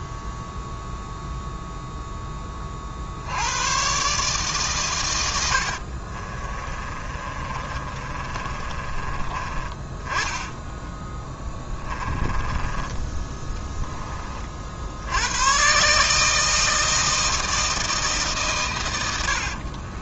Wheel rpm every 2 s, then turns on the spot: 0, 30, 130, 30, 30, 10, 20, 60, 160, 130.
6-10 12-14